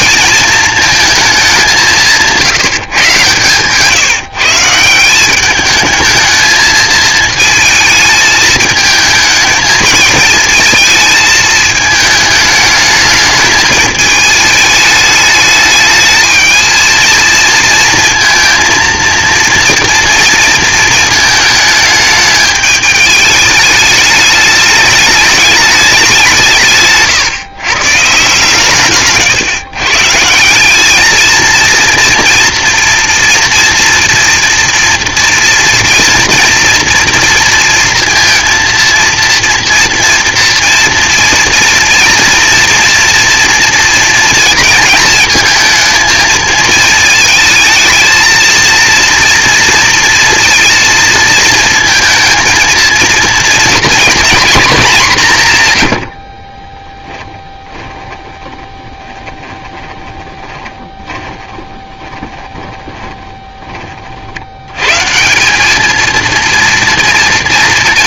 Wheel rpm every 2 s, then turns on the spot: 230, 160, 150, 220, 220, 220, 220, 220, 220, 230, 230, 210, 210, 180, 140, 190, 230, 230, 240, 230, 230, 230, 230, 220, 230, 230, 230, 230, 40, 20, 20, 40, 120, 230.
2-4 56-64